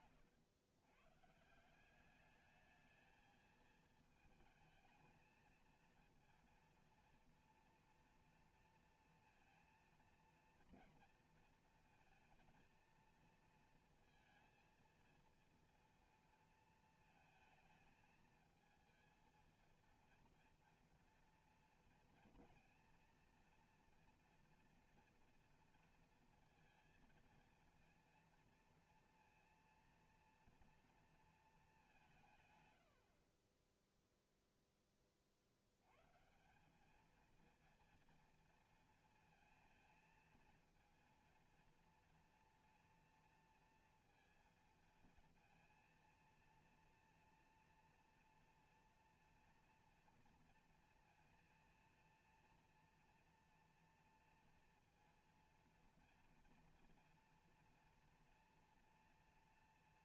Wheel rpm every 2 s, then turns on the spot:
120, 210, 220, 230, 230, 230, 230, 220, 230, 220, 230, 230, 230, 230, 230, 230, 110, 10, 190, 230, 230, 230, 230, 230, 230, 230, 230, 230, 230, 230.
none